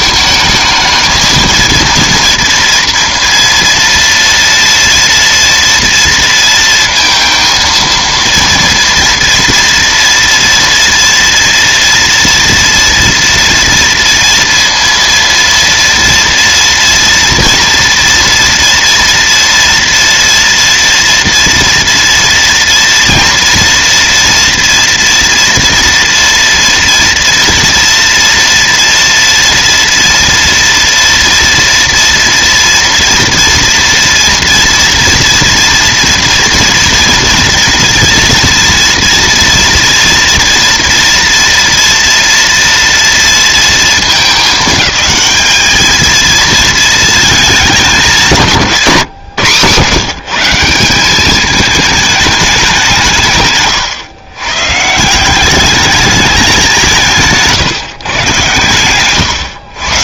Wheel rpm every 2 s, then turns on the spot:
220, 230, 230, 230, 230, 230, 230, 230, 230, 230, 230, 230, 240, 240, 230, 230, 230, 230, 230, 230, 240, 230, 210, 220, 160, 180, 180, 140, 180, 120.
none